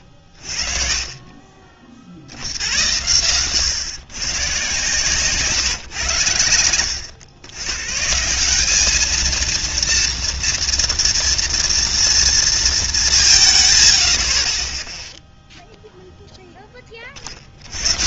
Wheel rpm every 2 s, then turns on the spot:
30, 70, 130, 100, 190, 230, 220, 30, 10.
none